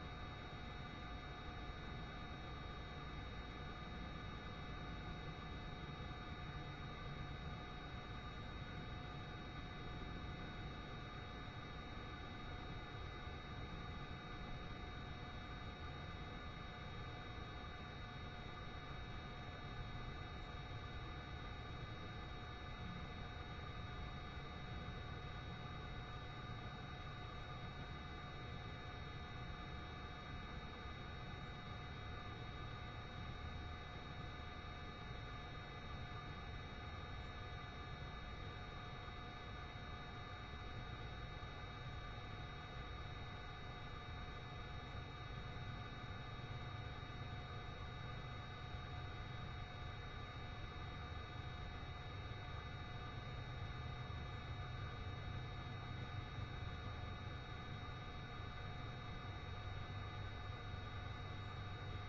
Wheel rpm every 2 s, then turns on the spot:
0, 0, 0, 0, 0, 0, 0, 0, 0, 0, 0, 0, 0, 0, 0, 0, 0, 0, 0, 0, 0, 0, 0, 0, 0, 0, 0, 0, 0, 0, 0.
none